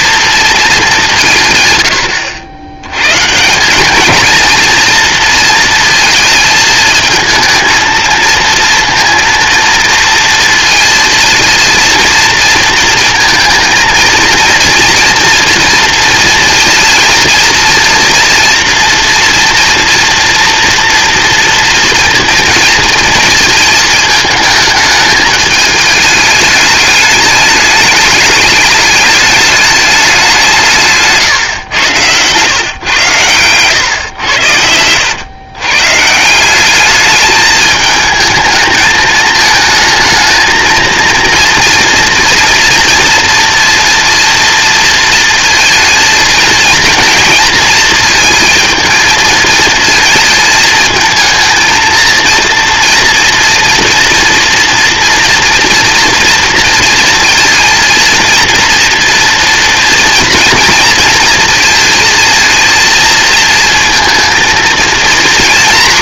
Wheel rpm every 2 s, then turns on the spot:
220, 70, 230, 220, 230, 230, 230, 230, 230, 230, 230, 230, 220, 210, 210, 180, 120, 100, 180, 220, 220, 230, 230, 230, 230, 220, 230, 230, 230, 230, 230, 230, 230.
none